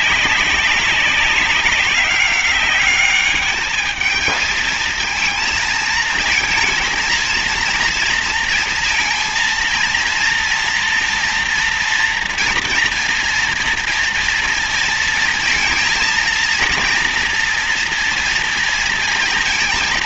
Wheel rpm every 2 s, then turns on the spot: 190, 200, 220, 230, 230, 230, 230, 230, 230, 230.
none